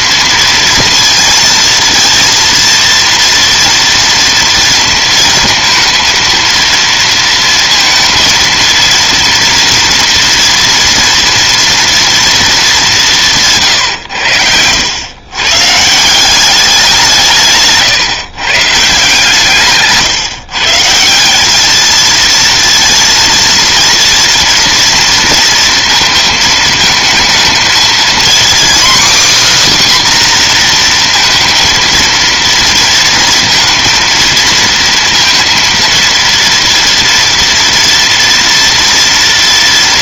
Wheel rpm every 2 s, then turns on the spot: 230, 230, 230, 230, 230, 240, 230, 90, 190, 150, 150, 230, 230, 220, 250, 260, 230, 230, 230, 230.
none